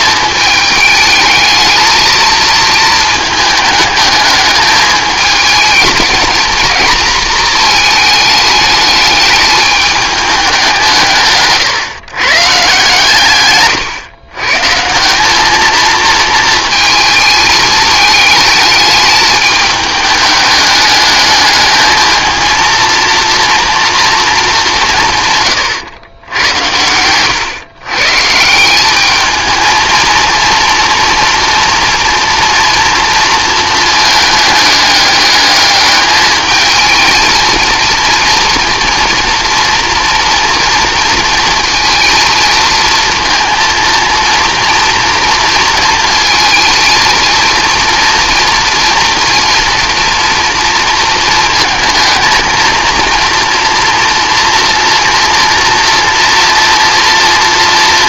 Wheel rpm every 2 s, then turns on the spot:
220, 220, 220, 230, 210, 180, 150, 160, 220, 210, 210, 230, 180, 100, 200, 230, 230, 210, 220, 230, 230, 230, 230, 220, 230, 230, 230, 230, 230.
26-28